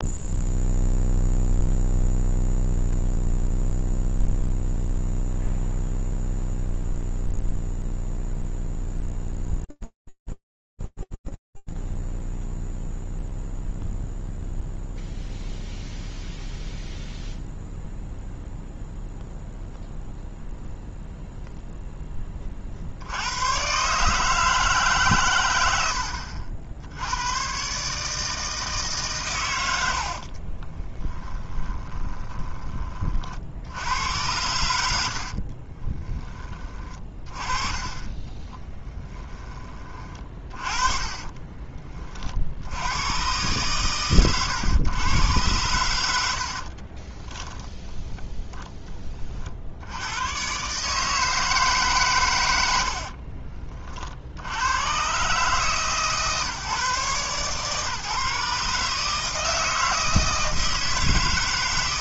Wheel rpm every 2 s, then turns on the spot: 0, 0, 0, 0, 0, 0, 0, 0, 0, 0, 0, 80, 110, 110, 130, 20, 30, 80, 30, 10, 30, 90, 110, 40, 20, 150, 80, 110, 140, 150, 160.
30-32 40-42 46-48 52-54